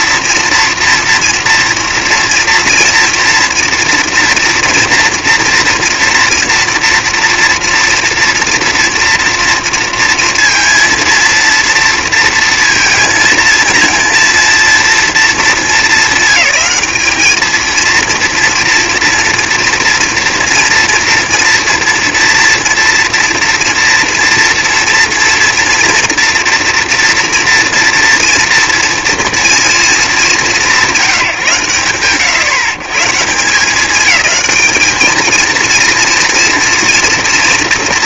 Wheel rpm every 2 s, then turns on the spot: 230, 230, 230, 240, 230, 230, 230, 200, 230, 240, 230, 230, 230, 230, 220, 100, 210, 230, 230.
none